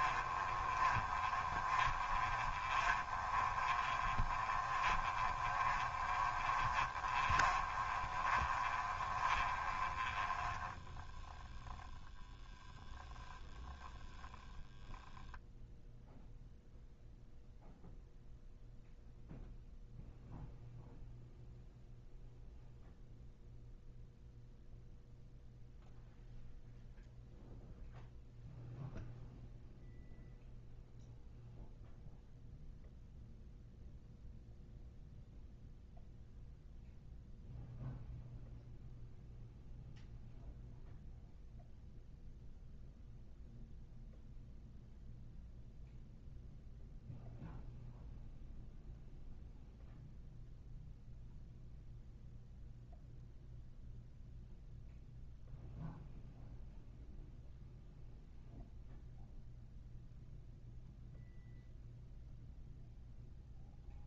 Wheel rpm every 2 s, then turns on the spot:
20, 20, 20, 20, 20, 10, 0, 0, 0, 0, 0, 0, 0, 0, 0, 0, 0, 0, 0, 0, 0, 0, 0, 0, 0, 0, 0, 0, 0, 0, 0, 0.
0-12